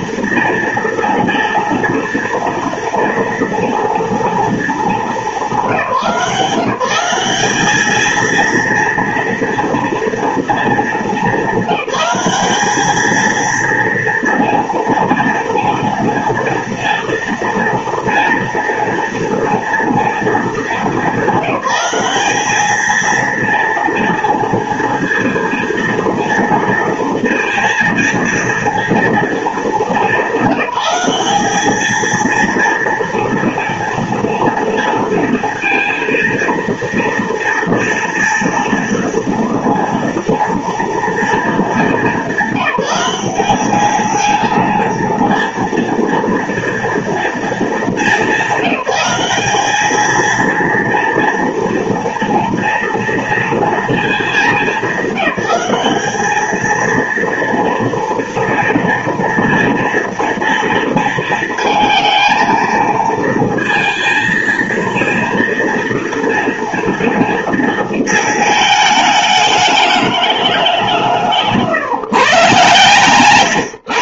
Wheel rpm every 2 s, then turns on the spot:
230, 230, 220, 170, 230, 230, 200, 230, 230, 240, 230, 210, 230, 230, 230, 200, 230, 230, 230, 230, 230, 190, 220, 230, 200, 230, 230, 220, 220, 230, 230, 220, 230, 230, 220, 200, 140.
none